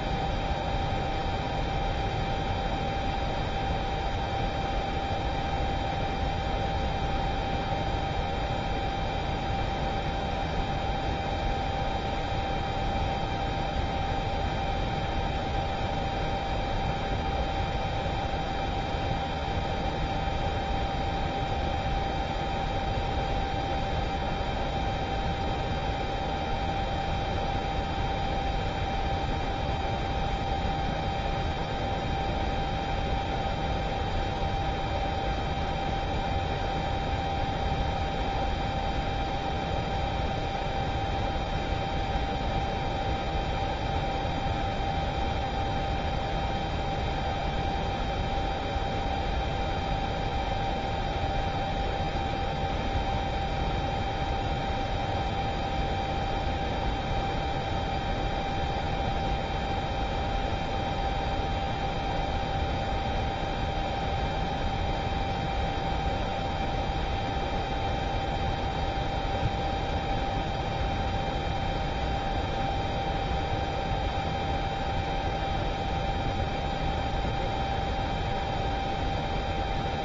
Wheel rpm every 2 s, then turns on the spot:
0, 0, 0, 0, 0, 0, 0, 0, 0, 0, 0, 0, 0, 0, 0, 0, 0, 0, 0, 0, 0, 0, 0, 0, 0, 0, 0, 0, 0, 0, 0, 0, 0, 0, 0, 0, 0, 0, 0, 0.
none